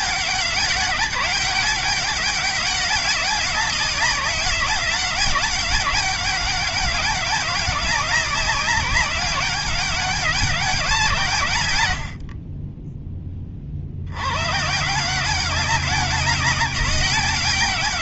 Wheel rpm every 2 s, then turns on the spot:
200, 200, 190, 190, 190, 170, 20, 140, 190.
12-14